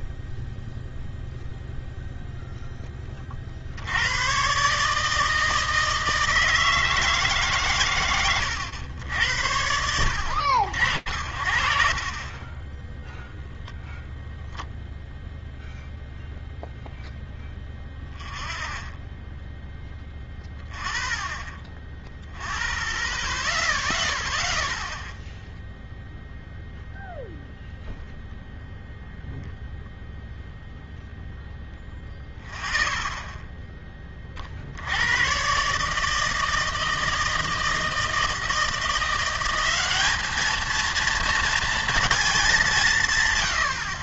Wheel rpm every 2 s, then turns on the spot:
0, 50, 160, 110, 100, 80, 0, 0, 0, 0, 0, 0, 0, 0, 0, 0, 0, 120, 160, 180, 230, 100.
none